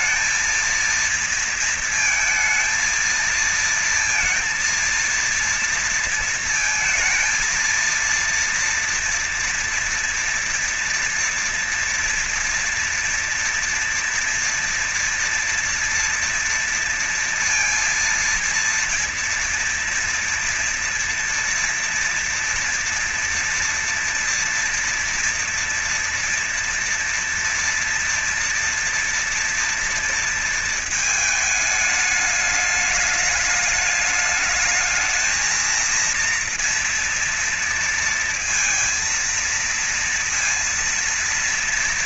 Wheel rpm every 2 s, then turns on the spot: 230, 230, 230, 230, 230, 230, 230, 230, 230, 230, 230, 230, 230, 230, 230, 230, 210, 210, 230, 230, 230.
none